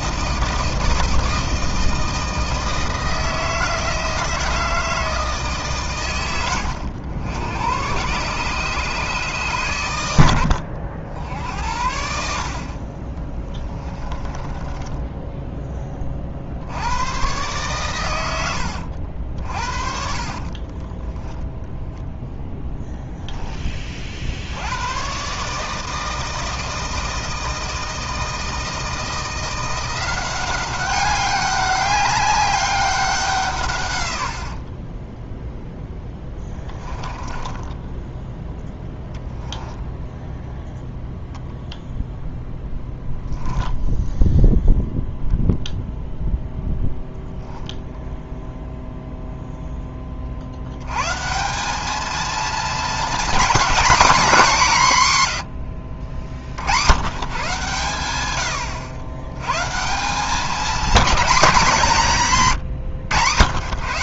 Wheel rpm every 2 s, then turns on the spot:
160, 160, 160, 90, 130, 70, 50, 20, 70, 80, 30, 0, 90, 160, 160, 190, 200, 50, 20, 10, 0, 0, 0, 10, 0, 80, 230, 200, 90, 90, 210, 150.
14-16 20-22 34-38